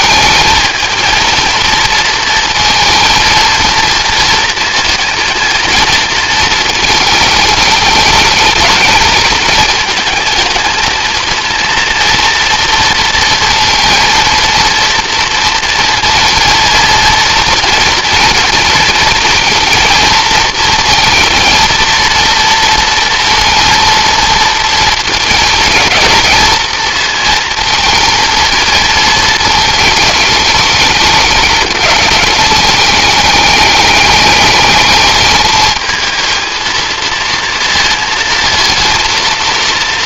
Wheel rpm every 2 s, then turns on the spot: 230, 230, 220, 220, 220, 230, 230, 230, 230, 230, 220, 230, 230, 230, 220, 210, 210, 210, 230, 230.
none